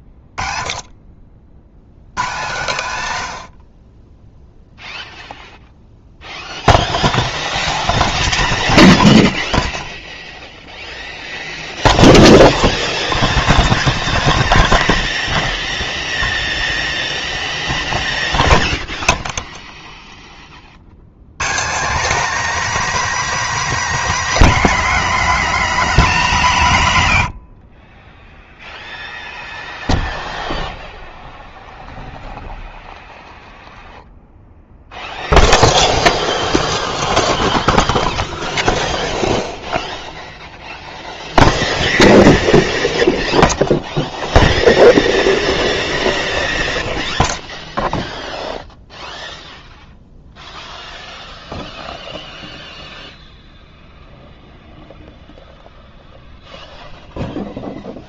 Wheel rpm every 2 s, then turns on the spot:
20, 120, 0, 0, 0, 0, 0, 0, 0, 0, 40, 280, 240, 150, 0, 0, 0, 0, 0, 0, 0, 0, 0, 0, 0, 0, 0, 0, 0.
none